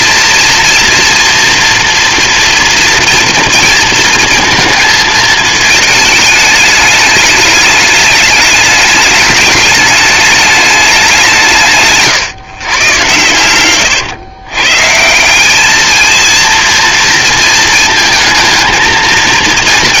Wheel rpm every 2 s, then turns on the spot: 230, 230, 220, 220, 210, 190, 130, 160, 230, 220.
none